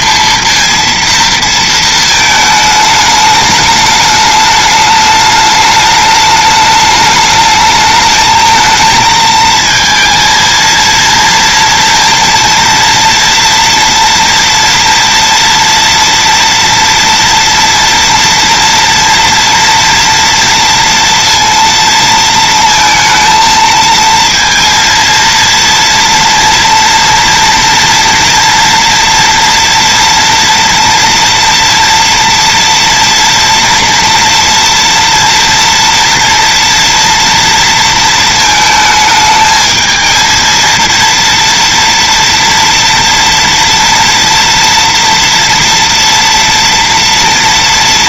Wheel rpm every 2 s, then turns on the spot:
230, 210, 210, 210, 220, 230, 230, 230, 230, 230, 230, 230, 230, 230, 230, 230, 230, 230, 230, 220, 230, 230, 230, 230.
none